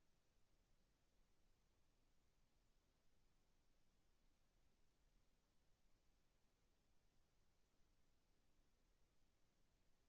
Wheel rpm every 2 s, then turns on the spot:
0, 0, 0, 0, 0.
none